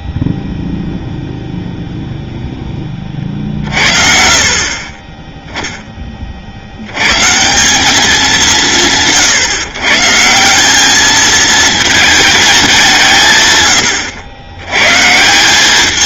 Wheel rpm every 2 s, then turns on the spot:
0, 0, 50, 20, 200, 170, 210, 110.
none